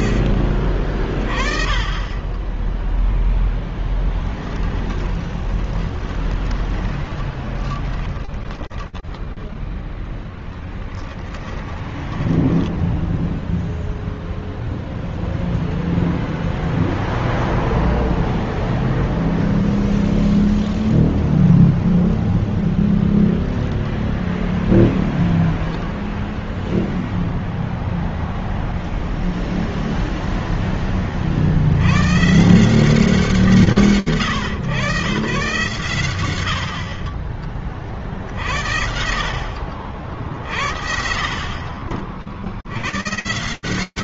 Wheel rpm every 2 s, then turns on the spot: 40, 20, 10, 20, 10, 10, 0, 0, 0, 0, 0, 0, 0, 0, 0, 10, 160, 110, 60, 60, 50, 120.
0-2 4-12